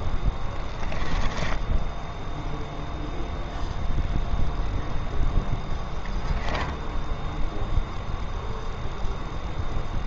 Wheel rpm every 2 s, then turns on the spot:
20, 0, 0, 10, 10.
0-2 6-8